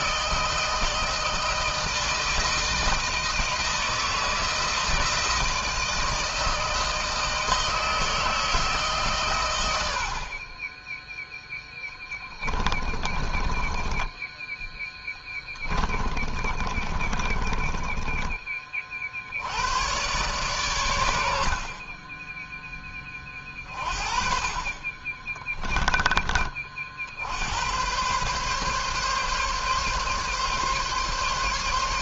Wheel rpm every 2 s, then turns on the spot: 160, 160, 160, 160, 130, 10, 30, 10, 30, 60, 90, 20, 30, 70, 140, 140.
12-18 24-26